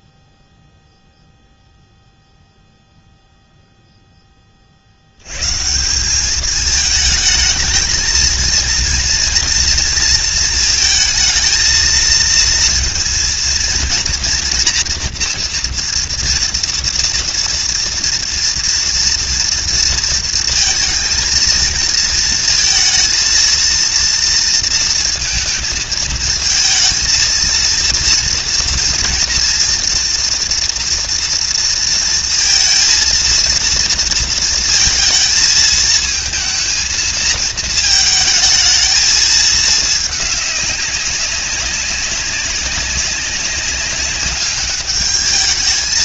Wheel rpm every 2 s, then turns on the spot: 0, 0, 70, 220, 230, 220, 230, 240, 240, 230, 220, 230, 230, 230, 230, 230, 230, 230, 220, 220, 190, 190, 210.
none